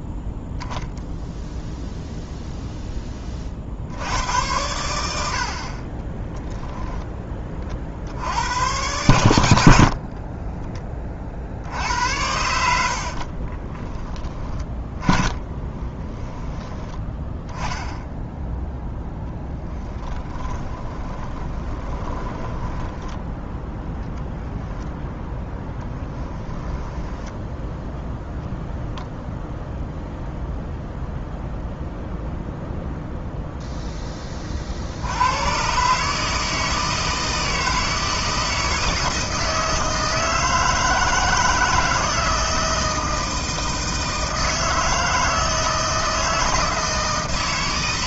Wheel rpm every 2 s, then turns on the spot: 0, 0, 100, 10, 100, 20, 80, 20, 10, 0, 30, 10, 0, 10, 0, 0, 0, 50, 160, 160, 160, 170, 160, 160.
10-16 20-24 26-28